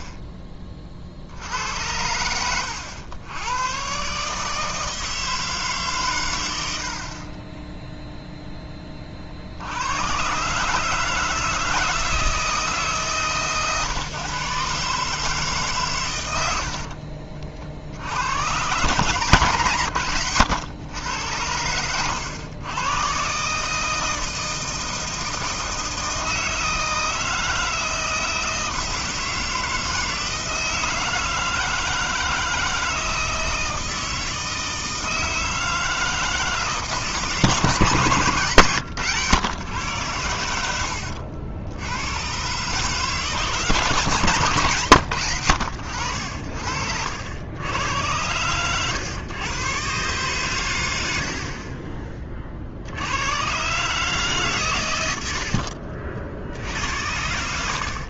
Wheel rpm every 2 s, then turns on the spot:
30, 90, 160, 90, 20, 150, 160, 150, 70, 140, 110, 100, 160, 160, 160, 160, 160, 160, 150, 140, 90, 140, 130, 60, 110, 130, 50, 140, 70.
16-18 40-42